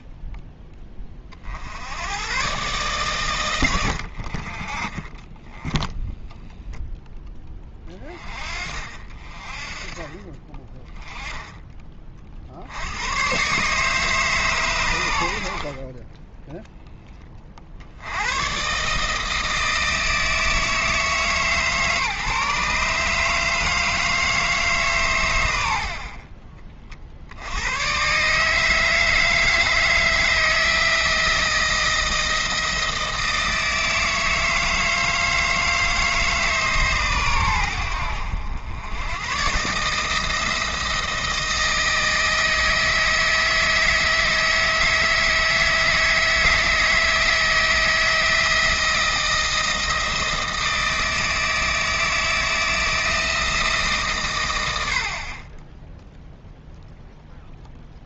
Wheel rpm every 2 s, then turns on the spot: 10, 130, 40, 10, 40, 20, 80, 120, 10, 140, 160, 150, 150, 40, 160, 160, 160, 160, 140, 90, 170, 160, 160, 160, 160, 160, 160, 90, 0.
4-6